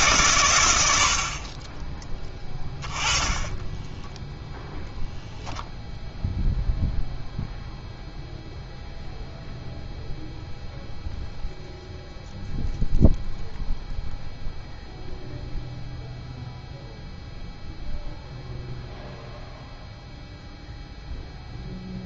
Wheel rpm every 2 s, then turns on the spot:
100, 20, 0, 0, 0, 0, 0, 0, 0, 0, 0.
none